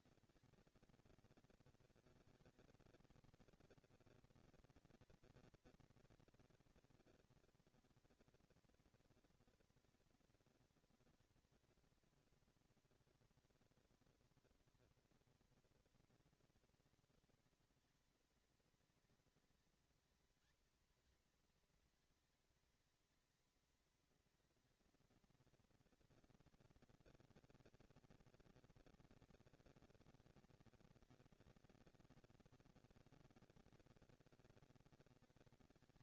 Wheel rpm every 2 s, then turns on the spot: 220, 220, 220, 220, 230, 220, 230, 230, 220, 210, 220, 220, 220, 220, 230, 230, 230, 230.
none